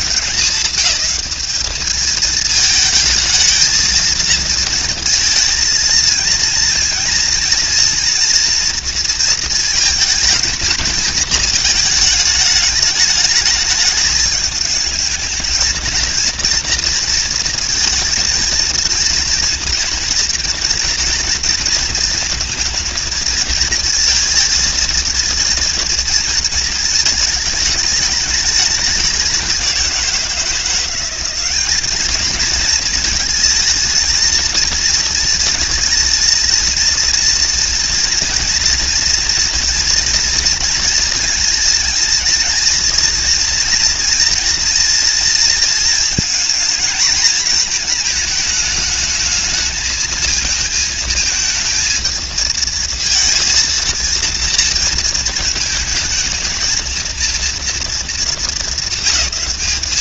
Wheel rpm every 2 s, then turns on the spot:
200, 220, 230, 230, 240, 220, 210, 210, 230, 220, 230, 230, 230, 220, 210, 170, 230, 220, 230, 230, 230, 230, 230, 220, 220, 230, 220, 230, 220, 220.
none